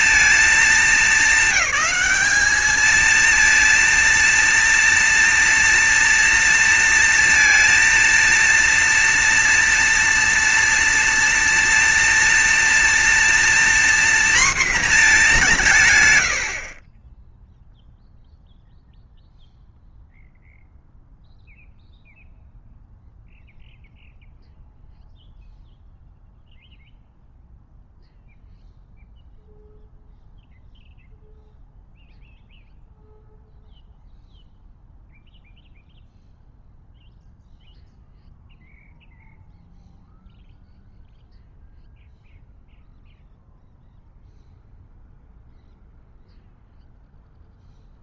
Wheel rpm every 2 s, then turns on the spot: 230, 220, 230, 230, 230, 230, 230, 240, 70, 0, 0, 0, 0, 0, 0, 0, 0, 0, 0, 0, 0, 0, 0, 0.
none